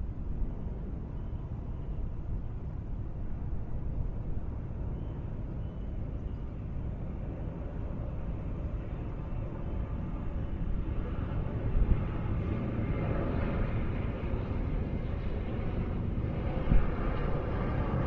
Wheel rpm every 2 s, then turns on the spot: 0, 0, 0, 0, 0, 0, 0, 0, 0.
none